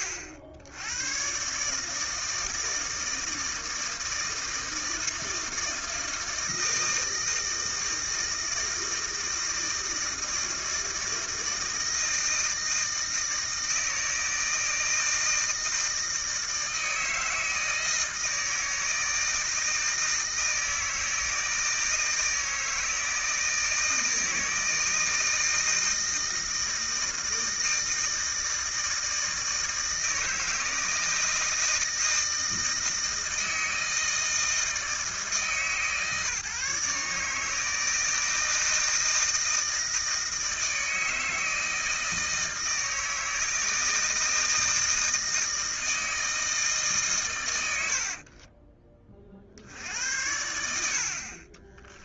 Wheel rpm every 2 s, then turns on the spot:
90, 160, 160, 160, 160, 160, 160, 160, 160, 160, 160, 160, 160, 160, 160, 160, 160, 160, 150, 160, 160, 160, 160, 150, 30, 70.
48-50